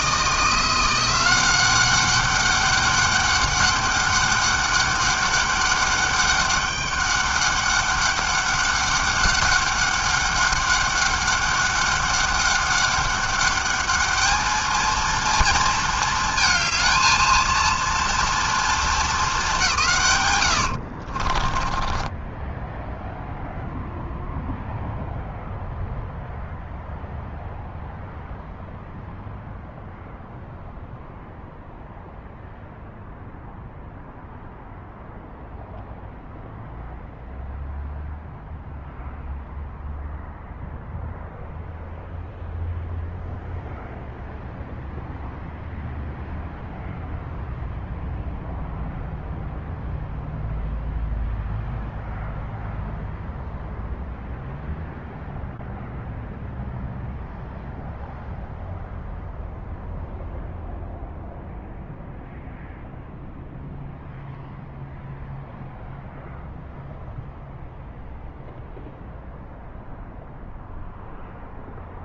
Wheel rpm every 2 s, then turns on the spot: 170, 200, 200, 200, 200, 200, 200, 220, 220, 230, 100, 10, 0, 0, 0, 0, 0, 0, 0, 0, 0, 0, 0, 0, 0, 0, 0, 0, 0, 0, 0, 0, 0, 0, 0, 0.
20-24